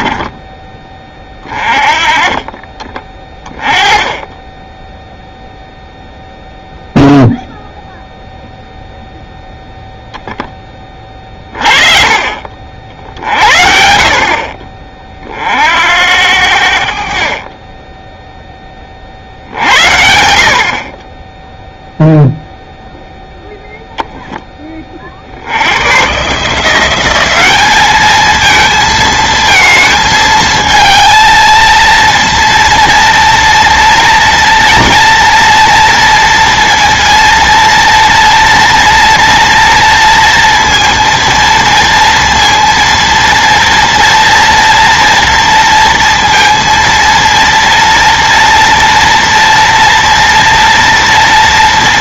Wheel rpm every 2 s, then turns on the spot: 20, 30, 10, 0, 0, 10, 50, 40, 70, 20, 40, 0, 20, 170, 220, 220, 230, 230, 230, 230, 230, 230, 230, 230, 230, 230.
none